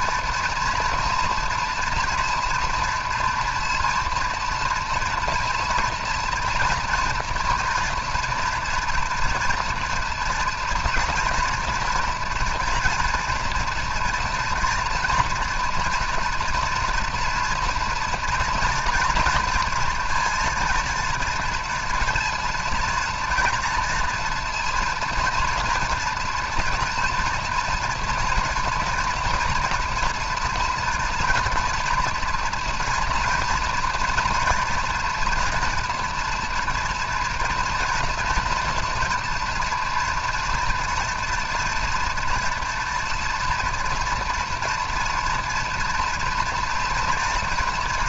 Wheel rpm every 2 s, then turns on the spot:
230, 230, 230, 230, 230, 240, 240, 230, 240, 230, 230, 230, 230, 230, 230, 230, 230, 230, 230, 240, 240, 230, 230, 230.
none